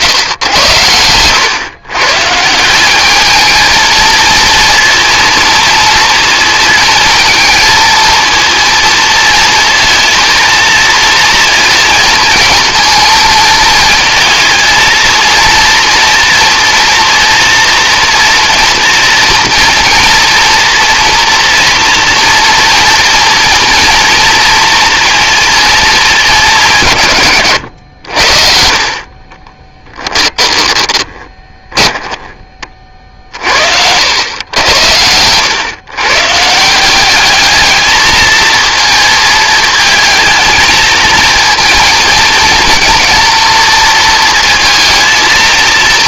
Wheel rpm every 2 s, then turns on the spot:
100, 210, 230, 230, 230, 230, 220, 230, 230, 230, 240, 230, 230, 130, 40, 10, 40, 100, 190, 230, 220, 230, 230.
28-32